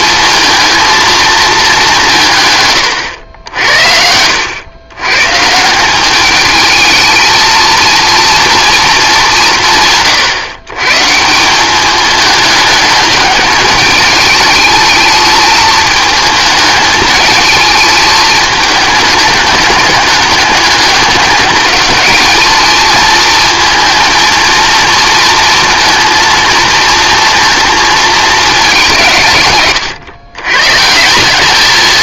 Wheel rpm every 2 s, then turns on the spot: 230, 100, 100, 220, 220, 140, 210, 210, 210, 210, 200, 220, 230, 220, 200, 140.
none